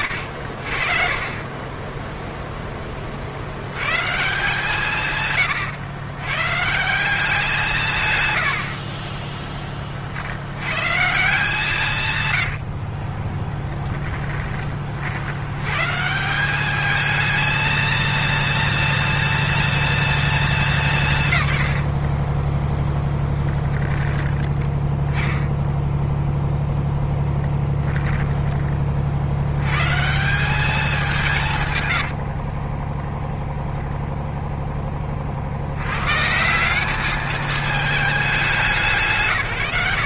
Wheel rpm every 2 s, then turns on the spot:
50, 10, 150, 130, 100, 70, 100, 20, 180, 230, 210, 20, 10, 0, 10, 180, 40, 0, 160, 220.
12-14 32-34